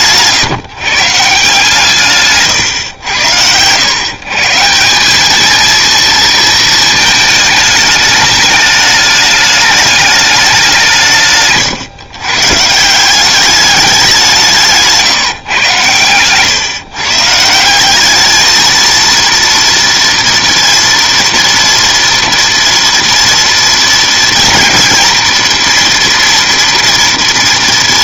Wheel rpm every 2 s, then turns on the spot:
150, 110, 170, 220, 210, 170, 160, 160, 130, 230, 230, 230, 230, 230.
none